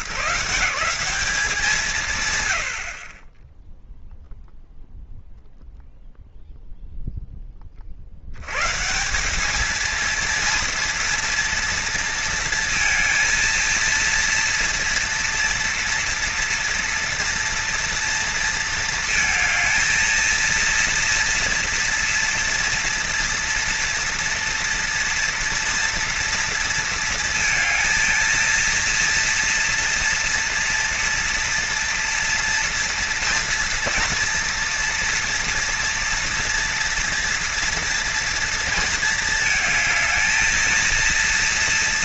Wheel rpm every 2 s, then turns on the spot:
150, 140, 0, 0, 130, 230, 230, 230, 230, 230, 230, 230, 230, 230, 230, 230, 240, 240, 230, 230, 220.
none